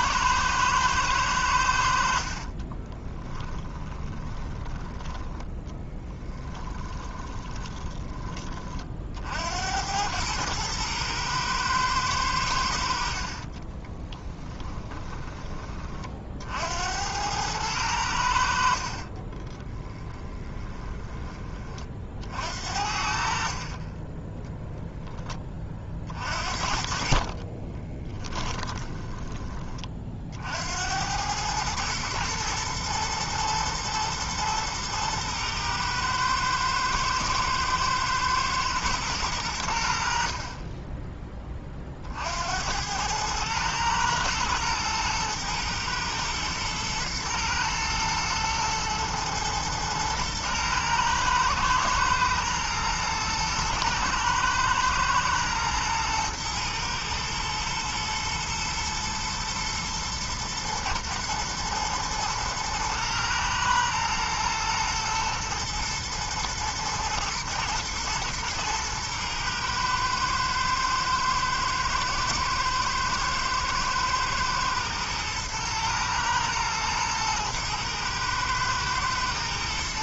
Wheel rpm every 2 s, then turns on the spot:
110, 20, 10, 20, 50, 110, 70, 20, 80, 50, 20, 60, 10, 50, 20, 90, 120, 110, 110, 110, 20, 100, 110, 110, 120, 110, 120, 110, 110, 120, 120, 110, 110, 110, 120, 120, 110, 110, 110, 110.
2-4 6-8 14-16 18-20 28-30